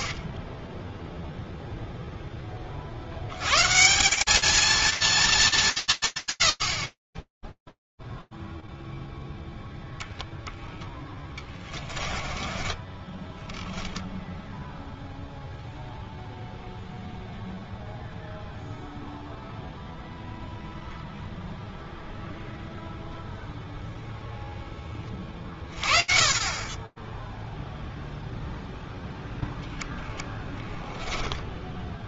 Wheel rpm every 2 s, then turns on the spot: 40, 60, 230, 150, 0, 0, 20, 0, 0, 0, 0, 0, 30, 0, 0, 10.
12-14 30-32